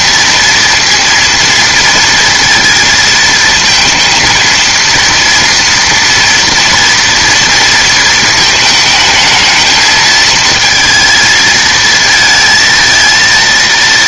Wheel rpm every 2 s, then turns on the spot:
230, 230, 230, 230, 220, 220, 220.
none